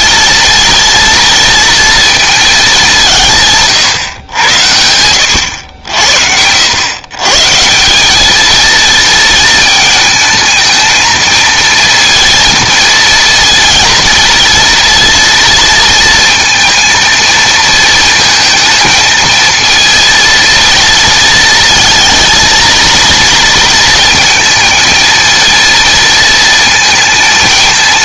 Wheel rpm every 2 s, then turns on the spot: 230, 200, 100, 110, 230, 220, 230, 230, 230, 220, 230, 230, 230, 230.
none